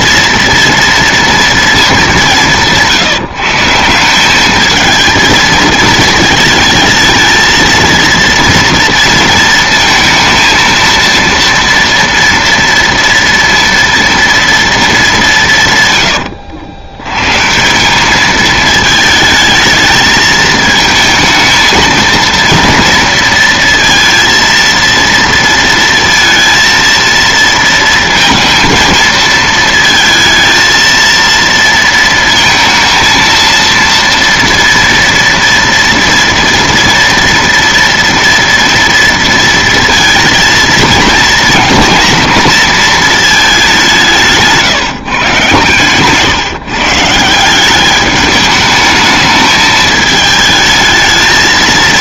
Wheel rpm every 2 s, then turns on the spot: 230, 180, 210, 220, 230, 230, 230, 230, 90, 220, 220, 230, 230, 230, 230, 220, 230, 230, 230, 230, 230, 220, 160, 150, 210, 220.
none